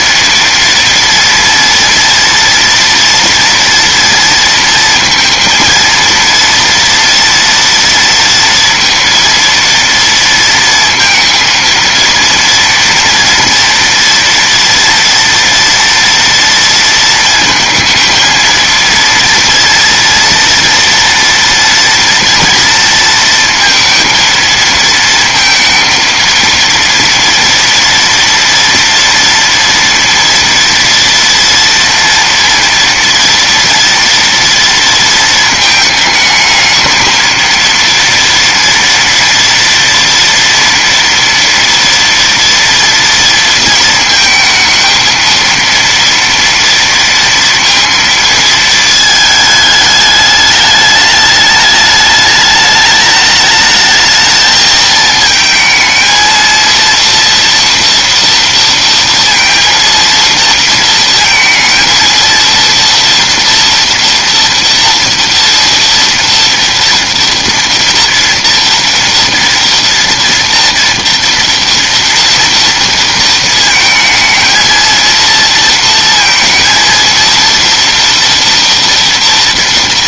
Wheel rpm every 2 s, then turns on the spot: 230, 230, 230, 240, 230, 230, 230, 230, 230, 230, 230, 230, 220, 230, 230, 230, 230, 230, 220, 230, 240, 230, 220, 230, 220, 210, 210, 220, 230, 230, 230, 230, 230, 230, 230, 230, 230, 230, 230, 230.
none